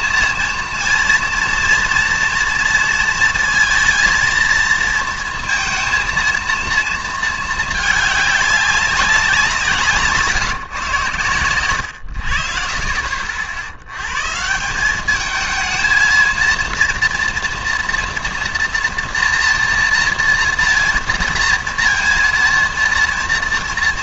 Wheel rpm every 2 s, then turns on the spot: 230, 230, 230, 230, 200, 150, 60, 180, 230, 230, 230, 230.
none